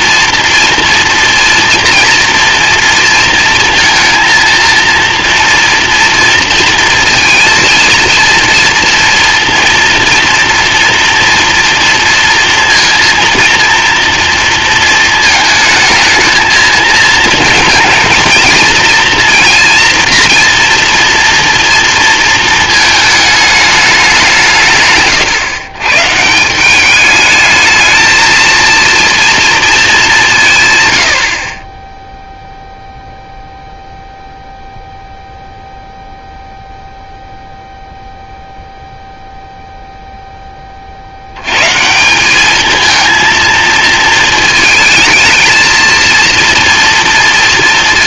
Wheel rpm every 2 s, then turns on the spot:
230, 230, 230, 230, 230, 230, 230, 230, 220, 230, 230, 220, 150, 190, 230, 120, 0, 0, 0, 0, 30, 220, 220, 230.
none